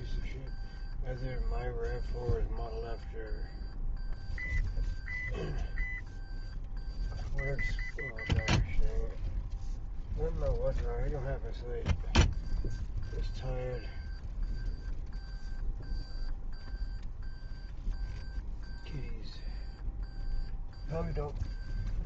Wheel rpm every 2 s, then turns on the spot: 0, 0, 0, 0, 0, 0, 0, 0, 0, 0, 0.
none